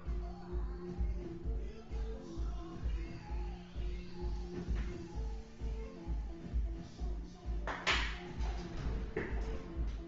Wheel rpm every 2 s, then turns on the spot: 0, 0, 0, 0, 0.
none